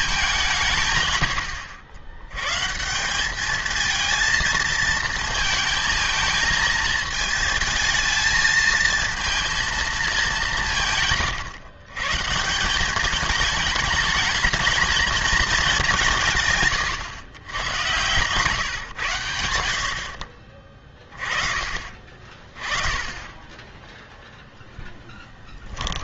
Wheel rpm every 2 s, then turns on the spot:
150, 140, 220, 220, 220, 170, 180, 220, 130, 130, 40, 30, 0.
none